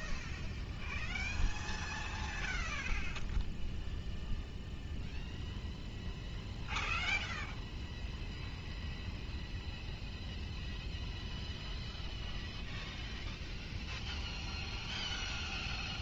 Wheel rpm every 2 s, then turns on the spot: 0, 0, 0, 0, 0, 0, 0, 0.
none